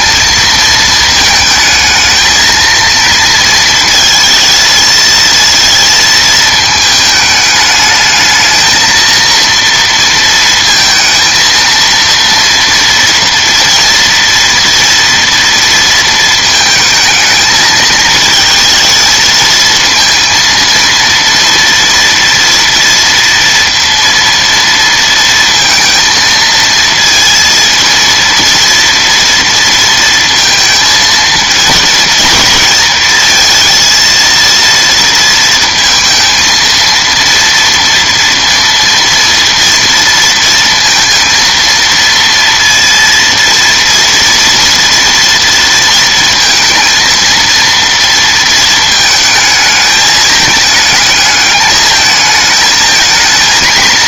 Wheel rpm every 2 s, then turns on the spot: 220, 230, 220, 220, 230, 230, 230, 230, 220, 220, 230, 230, 230, 230, 230, 230, 220, 230, 230, 230, 230, 230, 230, 230, 230, 210, 220.
none